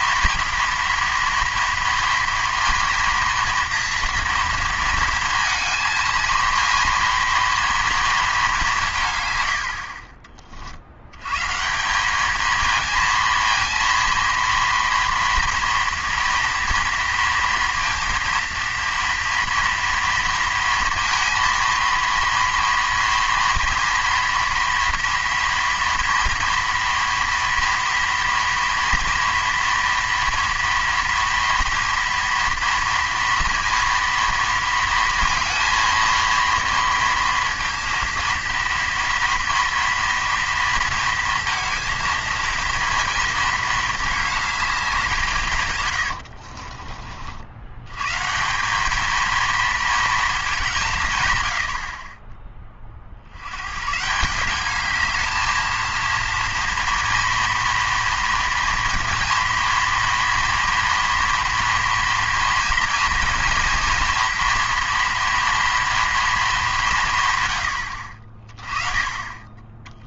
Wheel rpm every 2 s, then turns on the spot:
230, 230, 230, 230, 180, 60, 220, 230, 230, 230, 230, 230, 230, 230, 230, 230, 230, 230, 230, 230, 230, 230, 200, 50, 190, 180, 30, 200, 230, 230, 240, 230, 230, 200, 30.
46-48